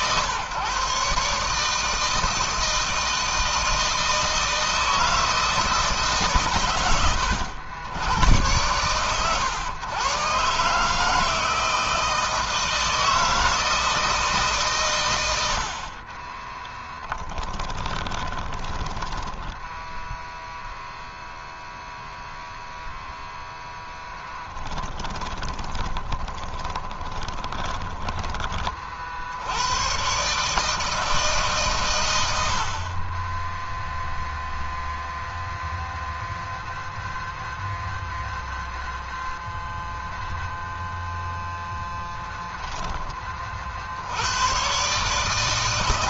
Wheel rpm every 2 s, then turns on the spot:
140, 160, 160, 90, 120, 160, 160, 100, 30, 10, 0, 0, 10, 20, 60, 150, 20, 0, 0, 0, 0, 30, 150.
16-20 24-28